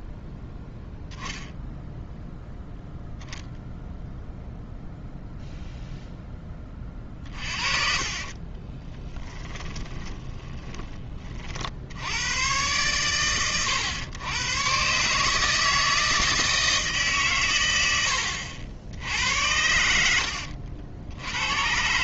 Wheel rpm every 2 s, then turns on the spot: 0, 0, 0, 20, 20, 20, 120, 130, 160, 80, 80.
8-10